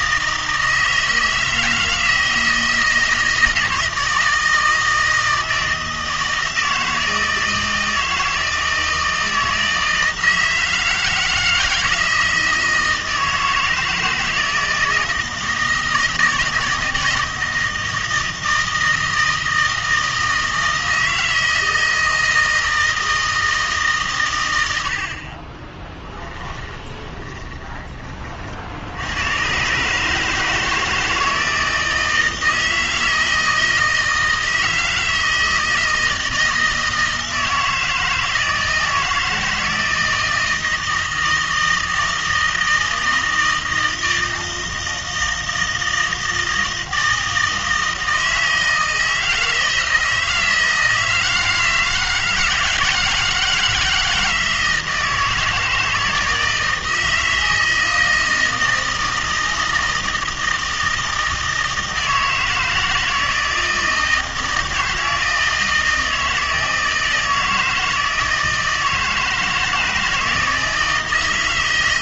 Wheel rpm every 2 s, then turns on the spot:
160, 160, 160, 160, 160, 160, 160, 160, 160, 160, 160, 160, 90, 10, 70, 160, 160, 160, 160, 160, 160, 160, 160, 160, 160, 160, 160, 160, 160, 160, 160, 160, 160, 160, 160, 160.
26-28